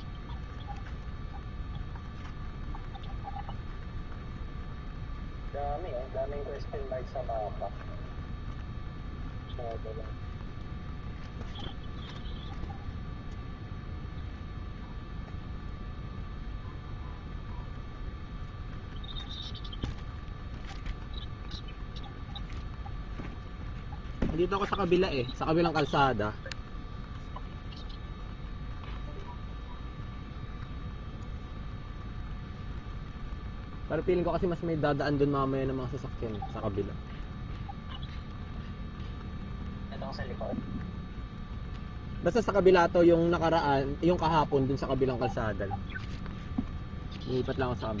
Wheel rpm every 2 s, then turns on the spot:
0, 0, 0, 0, 0, 0, 0, 0, 0, 0, 0, 0, 0, 0, 0, 0, 0, 0, 0, 0, 0, 0, 0, 0.
none